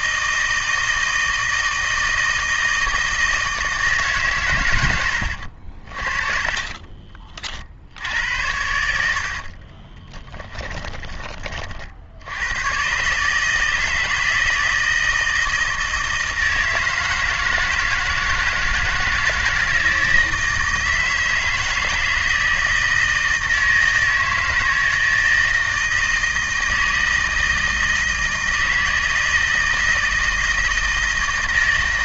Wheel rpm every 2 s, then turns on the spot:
160, 160, 100, 40, 80, 20, 130, 160, 160, 160, 160, 160, 160, 160, 160, 160.
6-10